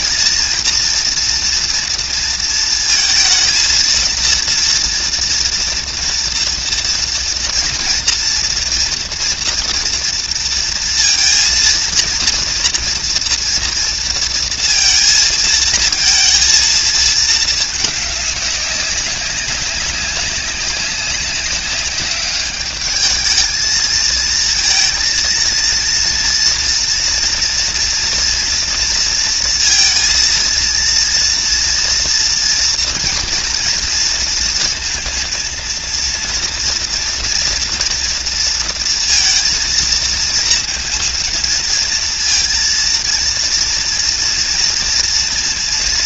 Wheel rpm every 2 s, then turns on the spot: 230, 230, 230, 230, 230, 230, 230, 230, 230, 210, 200, 200, 220, 230, 230, 230, 230, 230, 230, 230, 230, 230, 240.
none